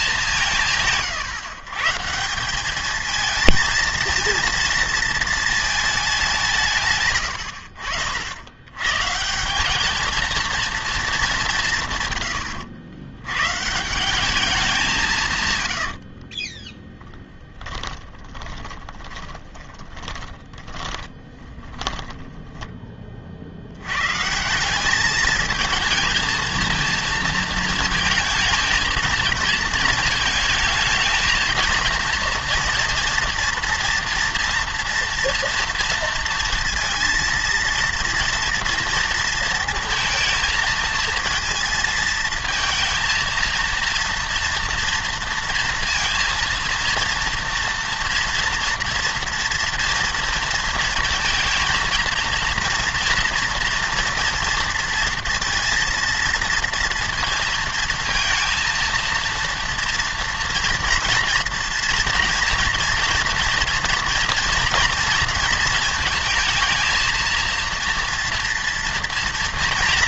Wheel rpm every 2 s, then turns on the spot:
150, 200, 230, 160, 100, 230, 100, 190, 20, 20, 20, 10, 180, 220, 220, 220, 230, 230, 230, 230, 230, 230, 230, 230, 240, 230, 230, 230, 230, 230, 230, 230, 230, 230, 240.
16-22